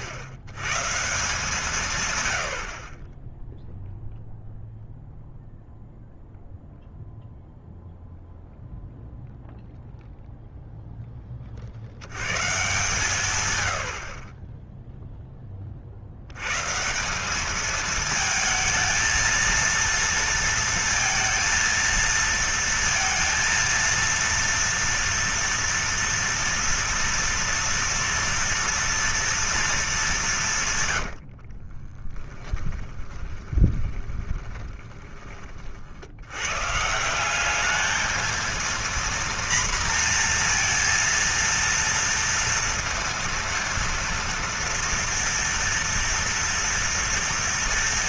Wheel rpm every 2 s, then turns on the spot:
110, 90, 0, 0, 0, 0, 140, 10, 120, 220, 230, 230, 230, 230, 230, 150, 10, 20, 120, 230, 230, 230, 230, 230.
30-36